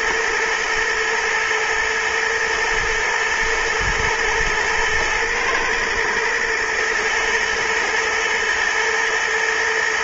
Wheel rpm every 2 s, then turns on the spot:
120, 110, 110, 110, 110.
none